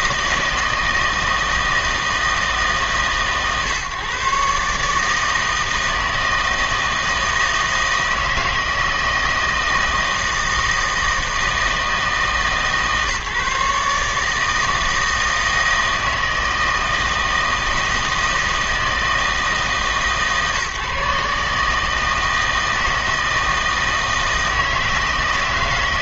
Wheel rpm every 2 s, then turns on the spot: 160, 140, 150, 160, 160, 160, 150, 160, 160, 160, 140, 160, 160.
none